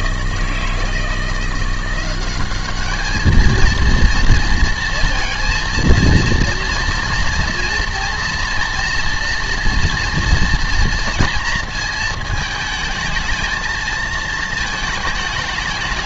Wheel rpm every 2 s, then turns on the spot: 160, 200, 230, 240, 240, 230, 220, 220.
none